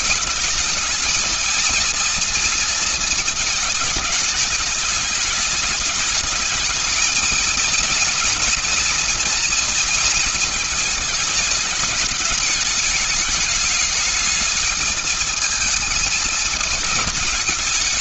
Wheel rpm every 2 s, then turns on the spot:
210, 230, 220, 220, 230, 230, 210, 220, 220.
none